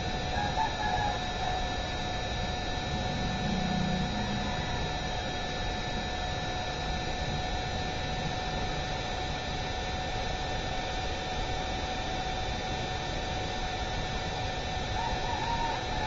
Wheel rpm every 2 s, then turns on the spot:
0, 0, 0, 0, 0, 0, 0, 0.
none